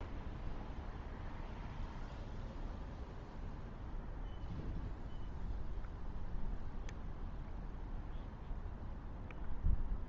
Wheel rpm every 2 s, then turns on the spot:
0, 0, 0, 0, 0.
none